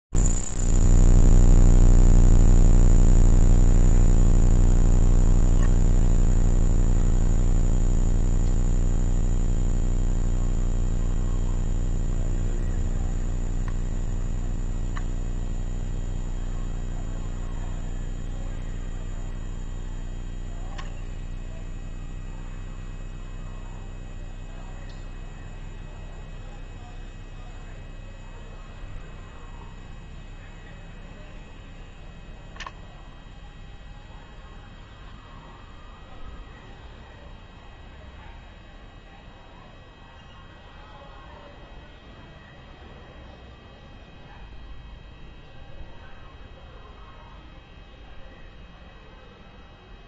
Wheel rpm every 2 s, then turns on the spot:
0, 0, 0, 0, 0, 0, 10, 0, 0, 0, 10, 0, 0, 0, 0, 0, 0, 0, 0, 0, 0, 0, 0, 0, 0.
none